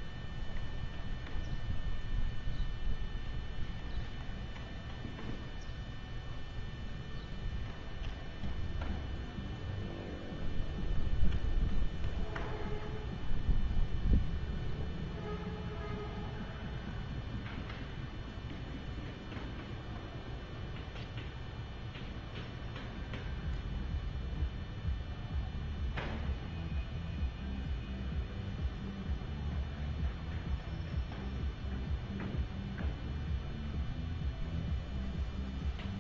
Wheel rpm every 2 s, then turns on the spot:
0, 0, 0, 0, 0, 0, 0, 0, 0, 0, 0, 0, 0, 0, 0, 0, 0, 0.
none